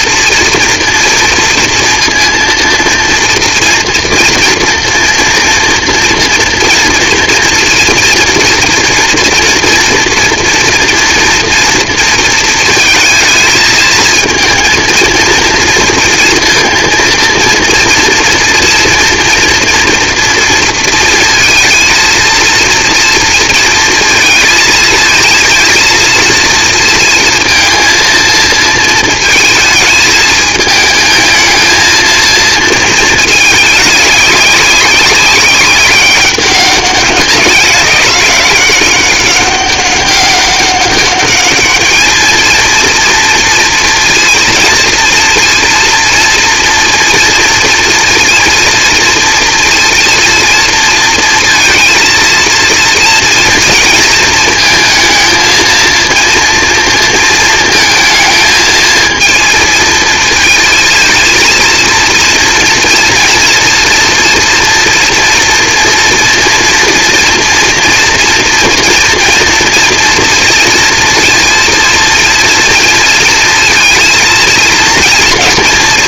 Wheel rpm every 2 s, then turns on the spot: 230, 230, 230, 230, 230, 240, 220, 220, 230, 230, 230, 230, 230, 230, 230, 220, 230, 200, 200, 190, 200, 230, 230, 230, 230, 230, 230, 230, 230, 230, 220, 230, 230, 240, 240, 230, 230, 230.
none